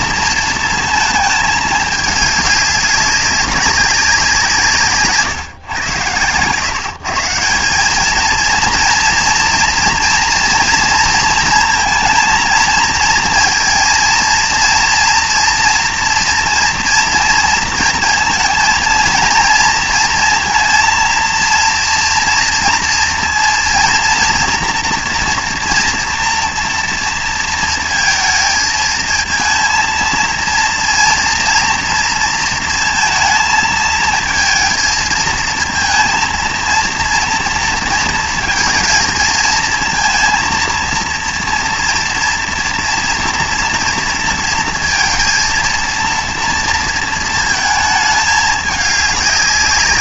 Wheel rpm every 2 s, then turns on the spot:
230, 200, 150, 150, 240, 230, 230, 230, 230, 230, 230, 230, 240, 230, 220, 230, 230, 220, 230, 230, 230, 230, 230, 230, 210.
none